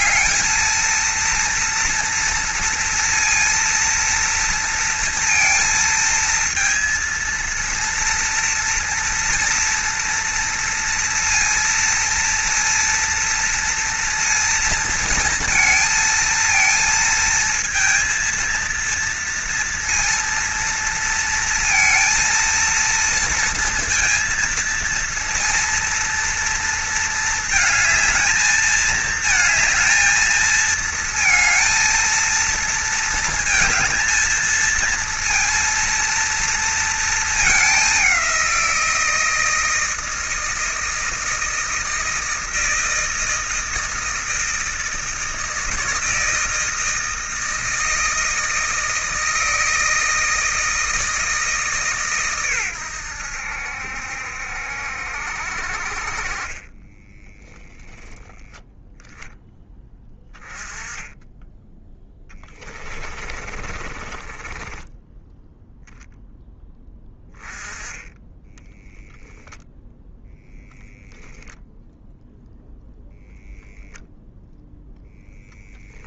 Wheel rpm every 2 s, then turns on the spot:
230, 230, 230, 230, 240, 230, 230, 230, 230, 230, 230, 230, 230, 230, 220, 220, 230, 230, 220, 170, 160, 160, 160, 160, 160, 160, 100, 70, 20, 10, 10, 20, 10, 10, 0, 0, 0, 0.
56-58 62-66